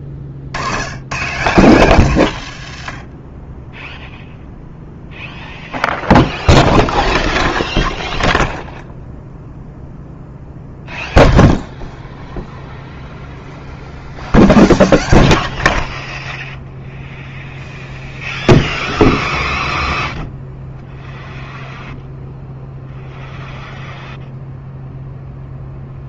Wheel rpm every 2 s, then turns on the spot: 90, 90, 0, 0, 0, 0, 0, 0, 0, 0, 0, 0, 0.
none